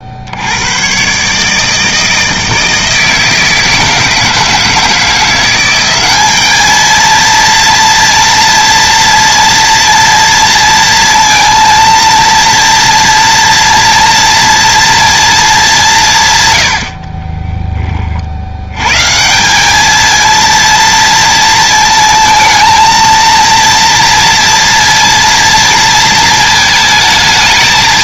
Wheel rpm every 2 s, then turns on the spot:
110, 160, 160, 220, 230, 230, 230, 230, 100, 100, 230, 230, 230, 220.
none